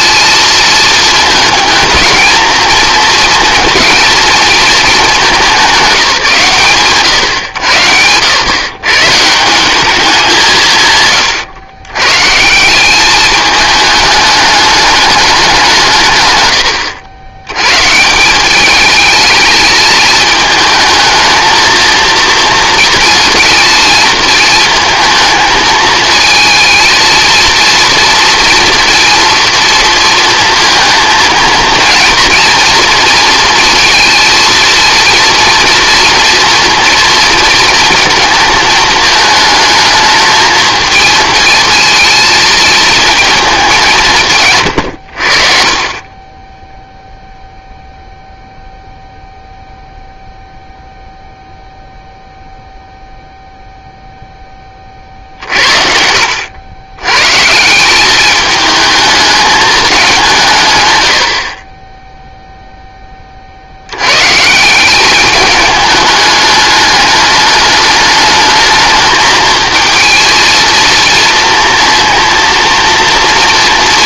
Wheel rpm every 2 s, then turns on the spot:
220, 220, 220, 150, 130, 150, 190, 210, 100, 210, 220, 230, 220, 230, 240, 230, 230, 230, 230, 220, 220, 230, 120, 10, 0, 0, 0, 30, 100, 210, 120, 10, 170, 210, 220, 230, 230.
none